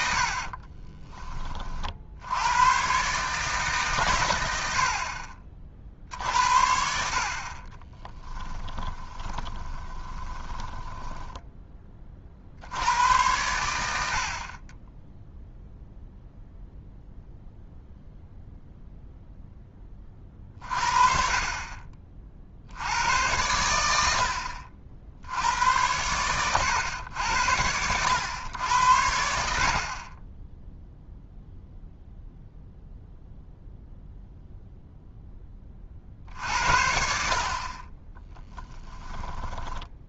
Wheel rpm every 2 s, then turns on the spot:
30, 120, 70, 70, 20, 10, 90, 30, 0, 0, 40, 80, 40, 110, 90, 0, 0, 0, 60, 10.
0-2 8-12 38-40